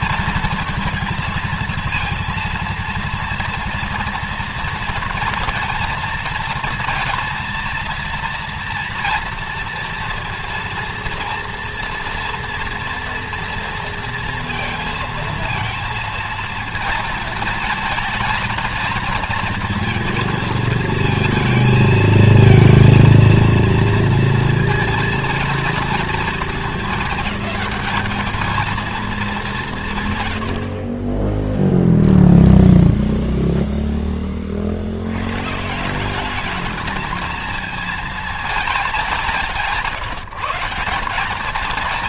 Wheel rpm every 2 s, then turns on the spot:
230, 230, 230, 230, 230, 230, 230, 230, 220, 220, 220, 230, 230, 220, 210, 40, 0, 70, 220, 200, 190.
none